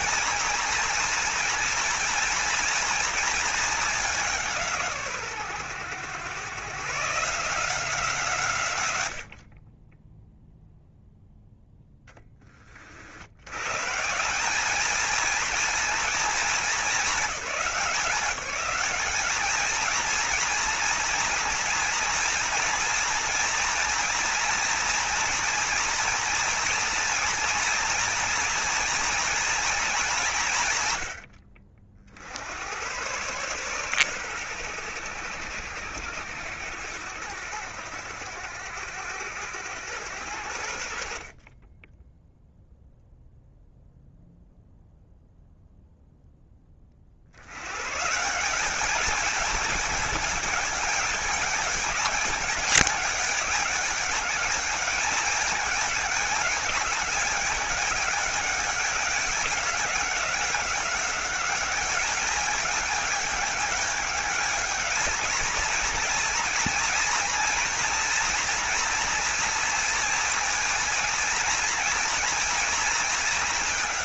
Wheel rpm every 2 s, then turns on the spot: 230, 230, 150, 140, 100, 0, 40, 210, 220, 200, 230, 230, 240, 230, 240, 120, 100, 100, 80, 80, 70, 0, 0, 20, 200, 210, 200, 200, 210, 200, 200, 210, 220, 240, 240, 230, 230.
none